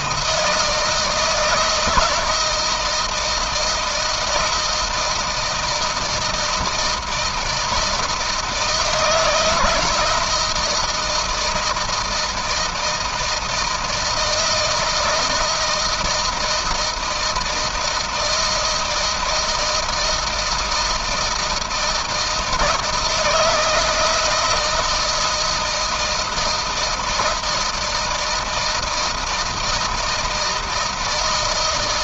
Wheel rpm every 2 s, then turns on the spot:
160, 160, 160, 160, 160, 160, 160, 160, 160, 160, 160, 160, 170, 160, 160, 160.
none